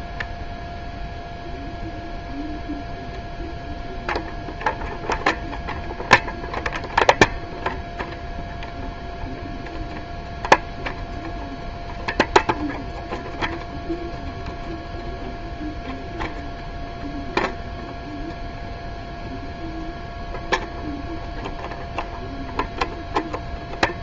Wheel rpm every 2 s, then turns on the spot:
0, 0, 0, 0, 0, 0, 0, 0, 0, 0, 0, 0.
none